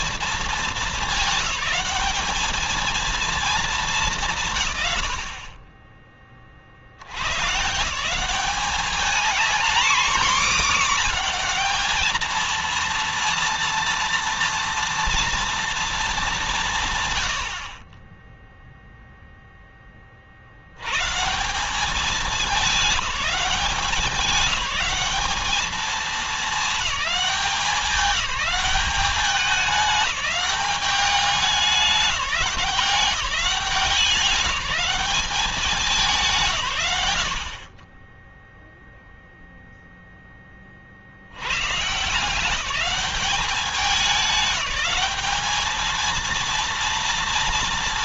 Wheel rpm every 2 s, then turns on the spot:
220, 220, 150, 40, 190, 230, 230, 240, 190, 10, 80, 210, 200, 210, 190, 200, 170, 190, 130, 10, 20, 180, 190, 230.
none